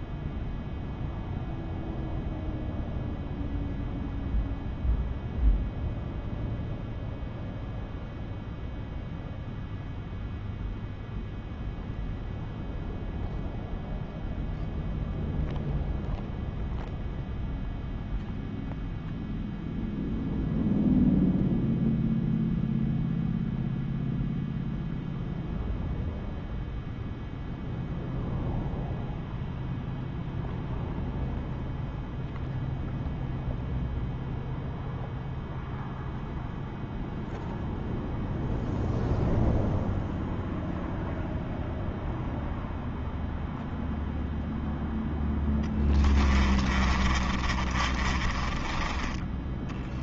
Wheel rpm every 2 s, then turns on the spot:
0, 0, 0, 0, 0, 0, 0, 0, 0, 0, 0, 0, 0, 0, 0, 0, 0, 0, 0, 0, 0, 0, 0, 30, 30.
46-50